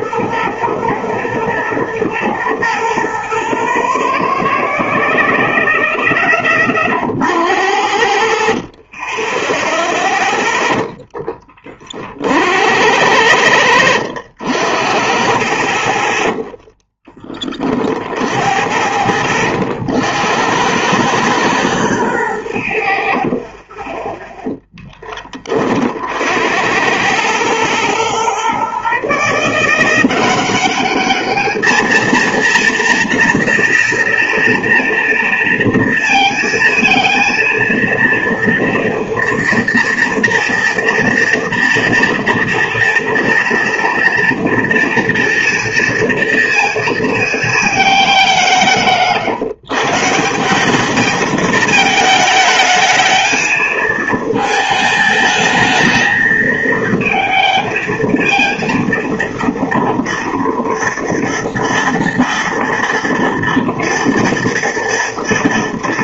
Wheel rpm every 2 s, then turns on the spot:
110, 90, 0, 40, 40, 10, 80, 60, 10, 60, 100, 70, 10, 90, 140, 200, 230, 230, 230, 230, 230, 230, 240, 230, 160, 200, 220, 220, 230, 230, 230, 230, 230.
none